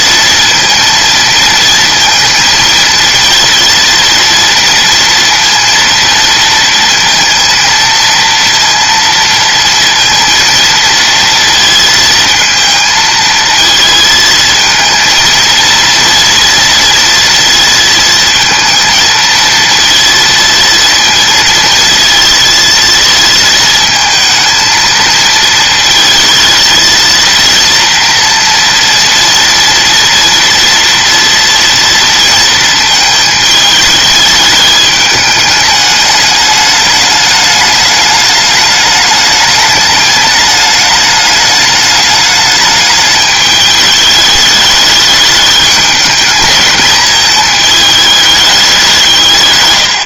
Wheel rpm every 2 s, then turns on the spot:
230, 230, 230, 230, 230, 230, 230, 230, 240, 220, 230, 230, 220, 230, 230, 240, 220, 210, 210, 210, 210, 210, 210, 210, 200.
none